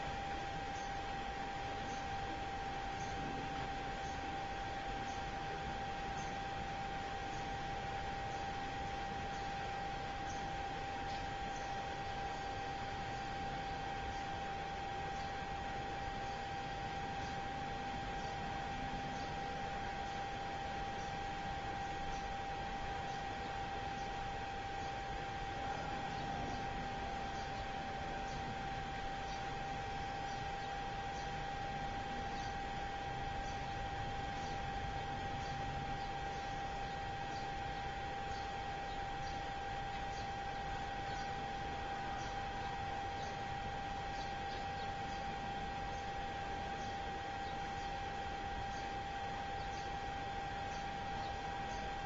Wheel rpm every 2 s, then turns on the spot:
0, 0, 0, 0, 0, 0, 0, 0, 0, 0, 0, 0, 0, 0, 0, 0, 0, 0, 0, 0, 0, 0, 0, 0, 0, 0.
none